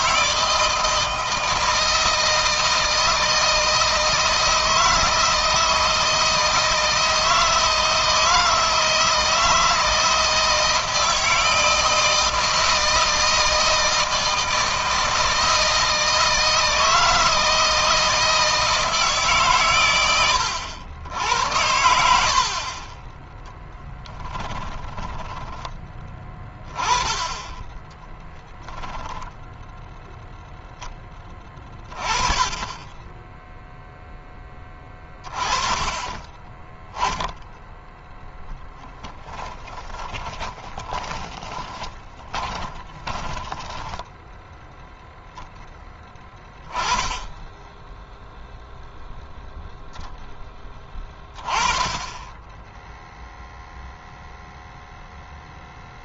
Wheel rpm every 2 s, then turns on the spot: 160, 160, 160, 170, 160, 160, 160, 160, 160, 160, 80, 30, 20, 20, 10, 10, 10, 20, 10, 10, 10, 20, 0, 10, 0, 20, 0, 0.
24-26 40-44